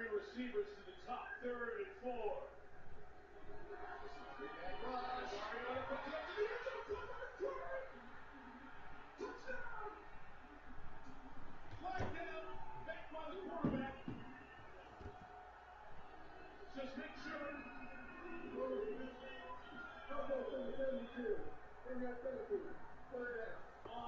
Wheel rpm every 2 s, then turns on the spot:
0, 0, 0, 0, 0, 0, 0, 0, 0, 0, 0, 0.
none